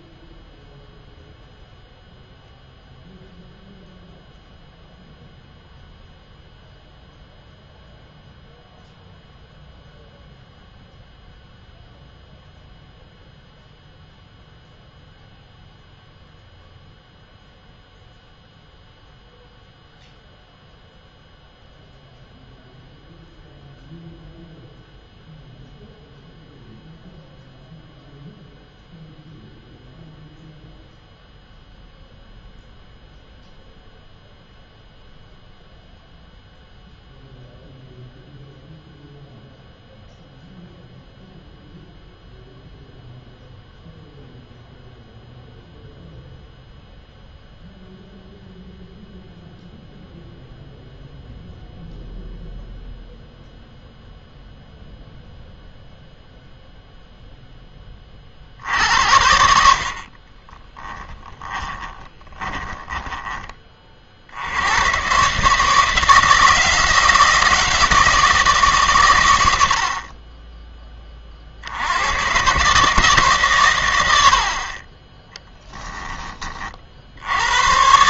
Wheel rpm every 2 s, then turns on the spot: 0, 0, 0, 0, 0, 0, 0, 0, 0, 0, 0, 0, 0, 0, 0, 0, 0, 0, 0, 0, 0, 0, 0, 0, 0, 0, 0, 0, 0, 70, 10, 10, 100, 160, 150, 10, 140, 30, 40.
60-64